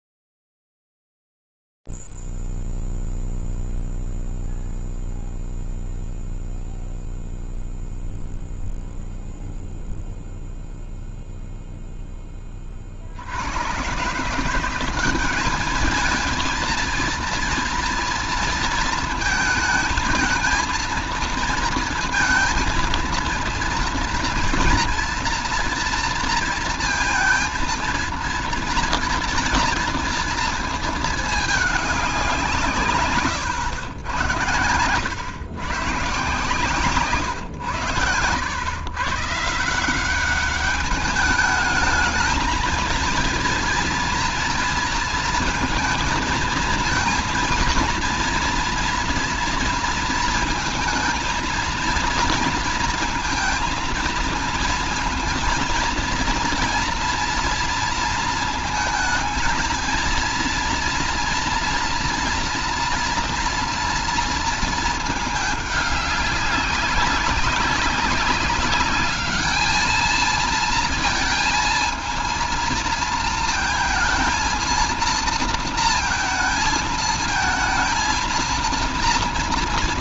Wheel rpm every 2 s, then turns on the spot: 0, 0, 0, 0, 0, 0, 0, 120, 210, 230, 220, 230, 230, 230, 230, 230, 180, 110, 140, 100, 190, 220, 230, 230, 230, 230, 230, 220, 230, 220, 230, 230, 230, 200, 200, 220, 230, 230, 220, 230.
none